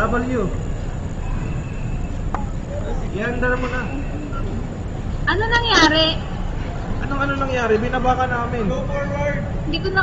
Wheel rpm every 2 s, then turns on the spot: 0, 0, 0, 0, 0.
none